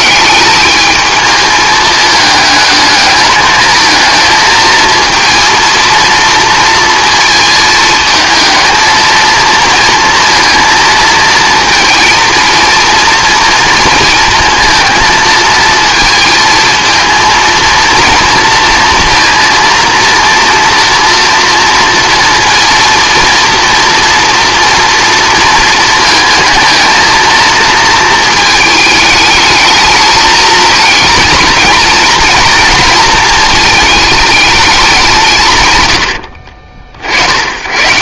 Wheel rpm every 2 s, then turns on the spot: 210, 220, 230, 230, 220, 230, 230, 230, 230, 230, 240, 230, 230, 220, 220, 230, 230, 210, 60.
none